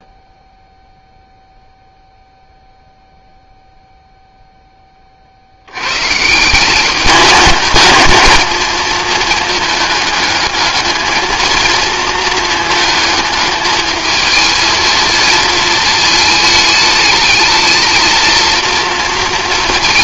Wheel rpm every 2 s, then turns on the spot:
0, 0, 10, 190, 220, 220, 220, 220, 210, 230.
none